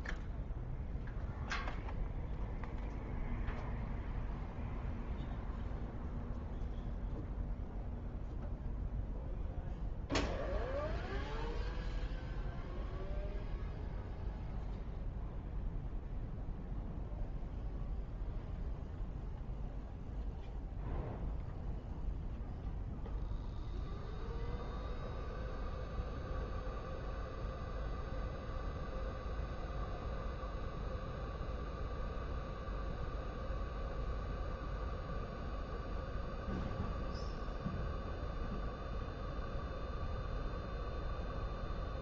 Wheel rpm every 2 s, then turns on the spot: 0, 0, 0, 0, 0, 0, 0, 0, 0, 0, 0, 0, 0, 0, 0, 0, 0, 0, 0, 0, 0.
none